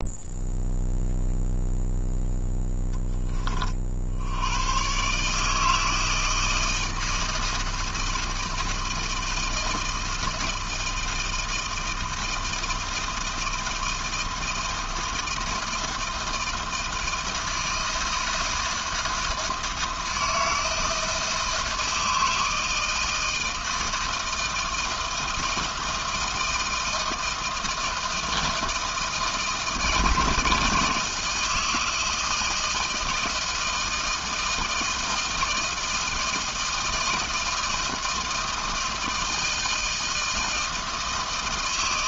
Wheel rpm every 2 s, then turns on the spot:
0, 10, 100, 160, 160, 160, 160, 160, 160, 160, 170, 160, 160, 160, 160, 160, 160, 160, 160, 160, 160.
none